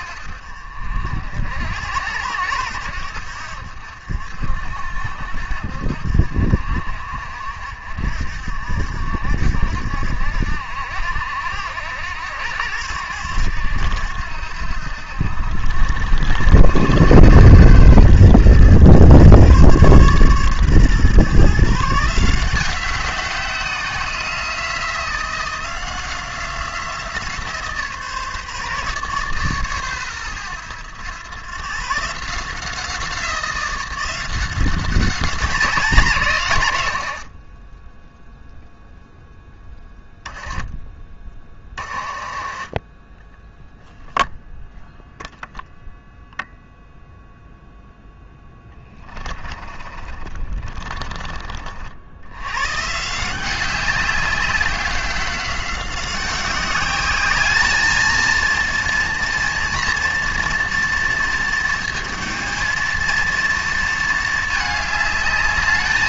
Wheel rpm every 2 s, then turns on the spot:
60, 80, 70, 60, 60, 70, 90, 80, 110, 120, 130, 180, 170, 170, 150, 100, 170, 190, 160, 0, 20, 30, 0, 0, 10, 30, 120, 190, 190, 230, 230, 230, 210.
40-44 48-52